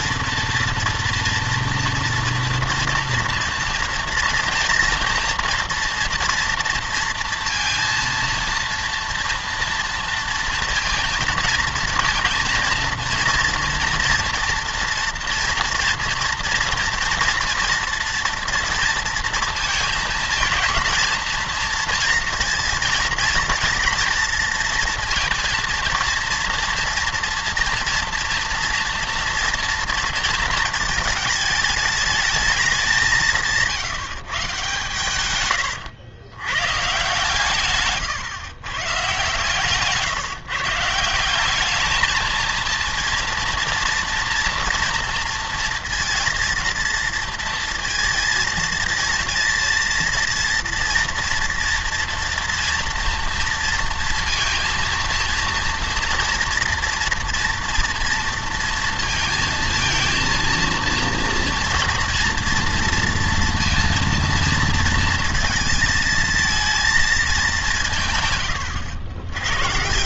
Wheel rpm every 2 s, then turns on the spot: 230, 240, 230, 230, 230, 230, 230, 230, 230, 230, 230, 230, 230, 230, 230, 230, 200, 140, 130, 130, 150, 230, 230, 230, 230, 230, 230, 230, 230, 230, 230, 230, 230, 230, 100.
none